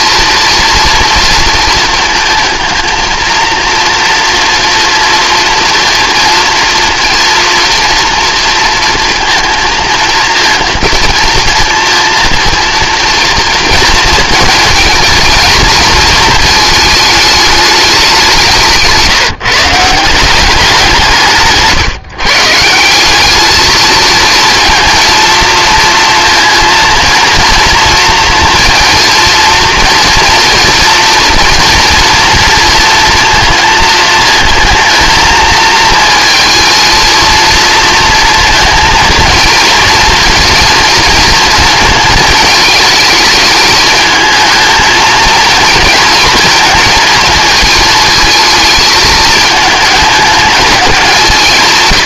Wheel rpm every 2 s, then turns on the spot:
230, 220, 230, 230, 230, 230, 230, 220, 220, 160, 190, 170, 230, 230, 230, 230, 230, 220, 220, 230, 230, 220, 220, 230, 220, 200.
none